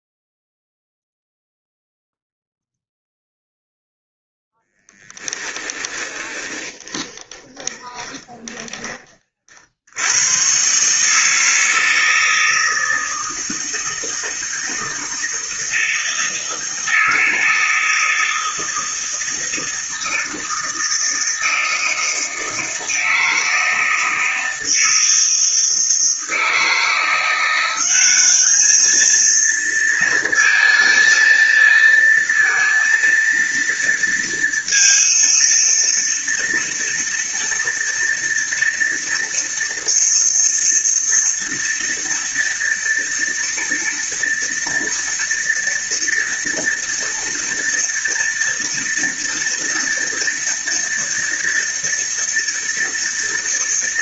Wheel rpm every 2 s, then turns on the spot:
0, 0, 10, 20, 20, 140, 160, 160, 160, 160, 160, 160, 160, 170, 220, 230, 230, 230, 230, 230, 230, 230, 230, 230, 230, 230, 230.
4-8